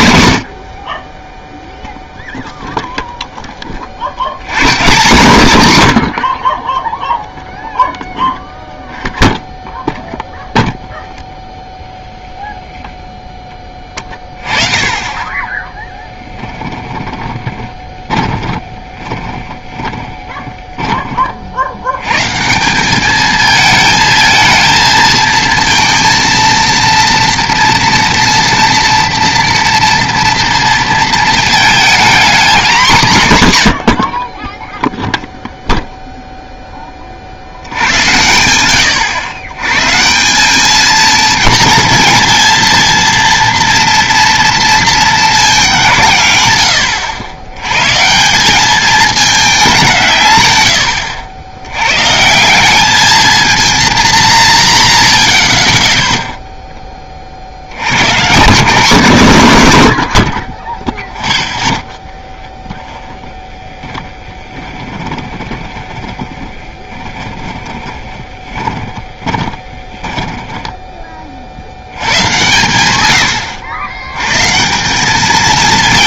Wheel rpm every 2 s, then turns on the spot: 80, 0, 120, 30, 0, 0, 0, 20, 10, 20, 20, 160, 220, 230, 230, 230, 230, 20, 10, 90, 200, 230, 230, 100, 190, 120, 180, 110, 0, 160, 20, 10, 20, 20, 30, 10, 120, 150.
16-22 62-72